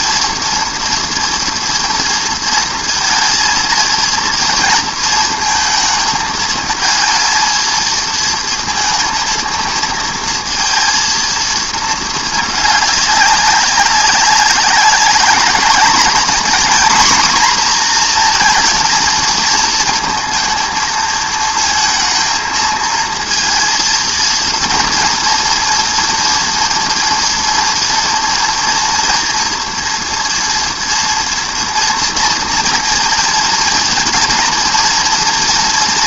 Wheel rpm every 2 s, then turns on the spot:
240, 230, 230, 220, 220, 230, 210, 190, 240, 230, 230, 230, 230, 230, 230, 230, 230, 230.
none